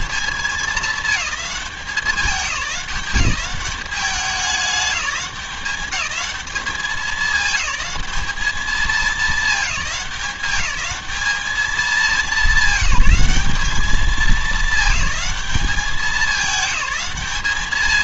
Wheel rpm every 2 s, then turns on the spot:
210, 190, 210, 210, 220, 210, 200, 200, 210.
none